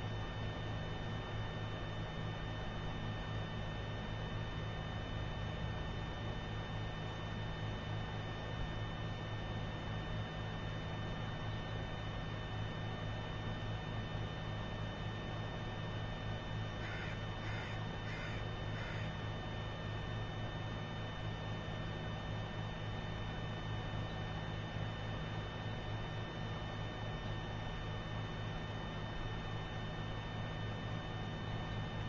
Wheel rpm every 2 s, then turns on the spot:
0, 0, 0, 0, 0, 0, 0, 0, 0, 0, 0, 0, 0, 0, 0, 0.
none